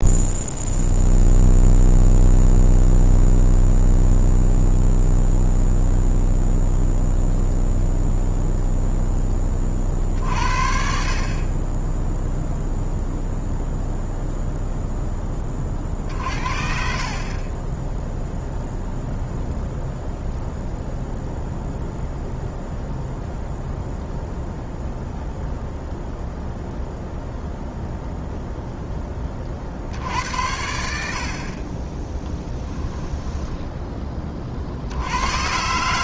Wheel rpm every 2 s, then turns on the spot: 0, 0, 0, 0, 0, 40, 0, 0, 50, 0, 0, 0, 0, 0, 0, 80, 10, 60.
32-34